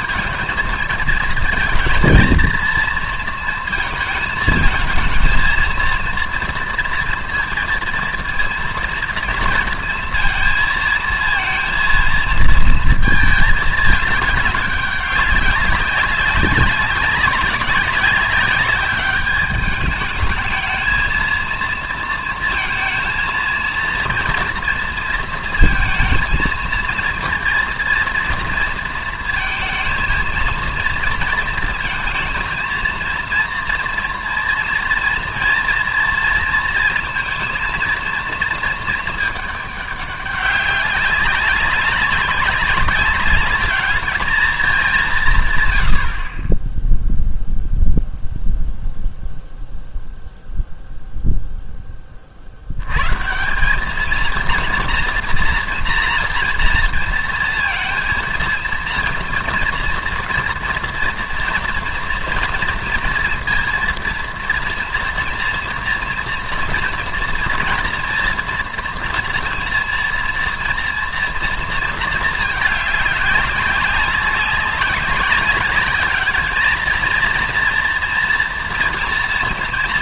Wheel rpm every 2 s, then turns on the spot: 230, 230, 220, 230, 230, 230, 220, 200, 200, 200, 220, 220, 230, 230, 230, 230, 230, 240, 230, 220, 200, 200, 210, 20, 0, 0, 70, 230, 240, 230, 230, 230, 230, 230, 230, 230, 210, 200, 220, 230.
none